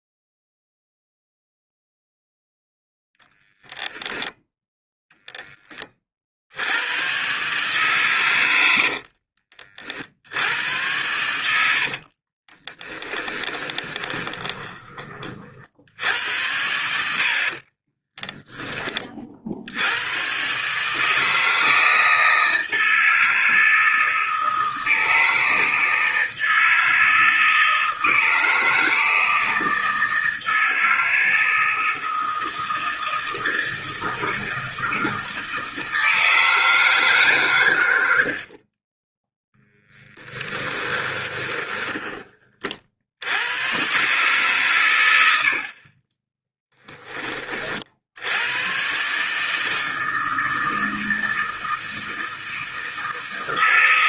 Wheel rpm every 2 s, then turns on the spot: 0, 0, 10, 120, 50, 90, 20, 30, 70, 30, 160, 160, 160, 160, 160, 160, 160, 160, 150, 10, 20, 70, 100, 30, 130, 160, 160.
8-10 12-14 40-42